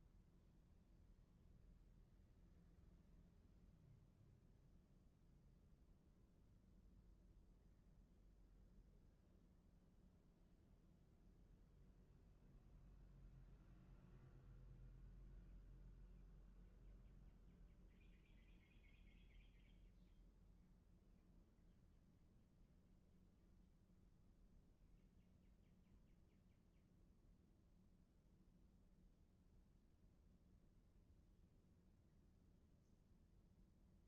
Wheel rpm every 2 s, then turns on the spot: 0, 0, 0, 0, 0, 0, 0, 0, 0, 0, 0, 0, 0, 0, 0, 0, 0.
none